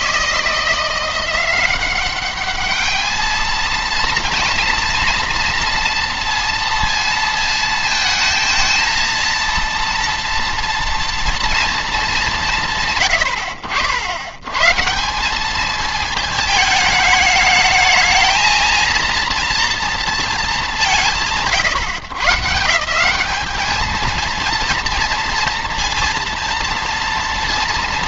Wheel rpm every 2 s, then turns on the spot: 170, 210, 230, 230, 220, 240, 160, 120, 210, 230, 200, 140, 230, 230.
none